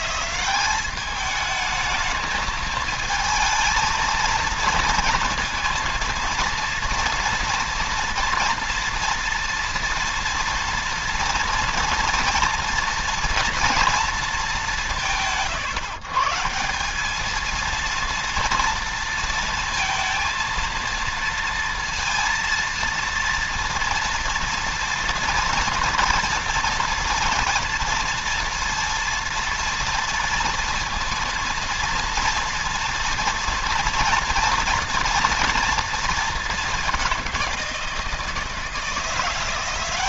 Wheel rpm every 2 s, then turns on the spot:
200, 220, 230, 230, 230, 240, 230, 180, 190, 230, 230, 230, 230, 230, 230, 230, 230, 230, 200, 170.
none